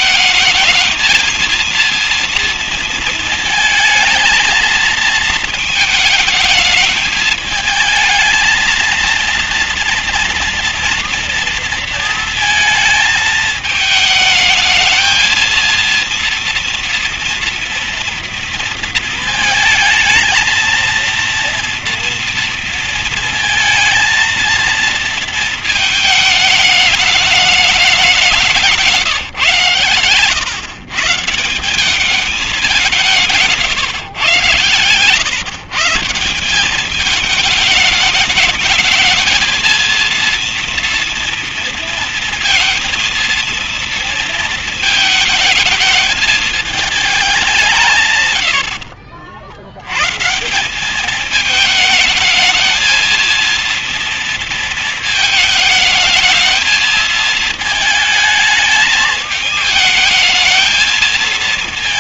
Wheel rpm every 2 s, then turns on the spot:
220, 220, 220, 220, 230, 230, 220, 220, 230, 230, 230, 230, 230, 210, 160, 150, 180, 110, 200, 220, 230, 230, 230, 220, 70, 190, 230, 220, 220, 220, 220.
48-50